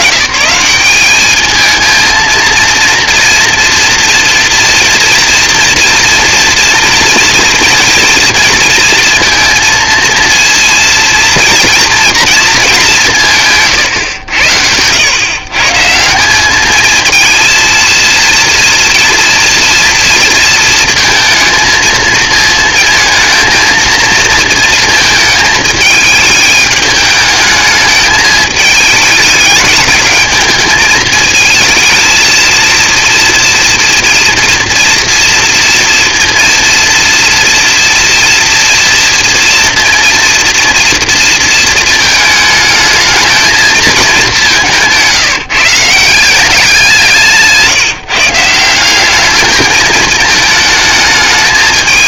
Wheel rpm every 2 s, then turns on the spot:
150, 230, 230, 230, 230, 230, 220, 100, 200, 230, 230, 230, 220, 210, 220, 210, 230, 230, 230, 230, 230, 220, 190, 190, 170, 220.
none